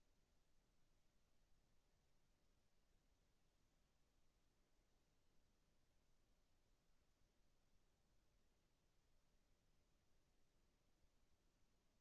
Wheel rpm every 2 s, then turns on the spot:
0, 0, 0, 0, 0, 0.
none